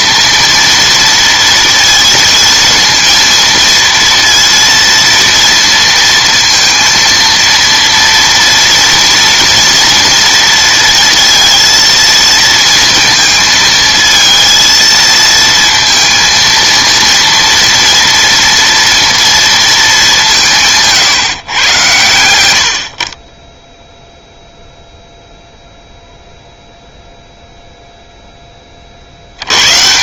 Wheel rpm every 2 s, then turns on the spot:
230, 230, 230, 230, 230, 230, 230, 230, 230, 230, 170, 70, 0, 0, 10.
none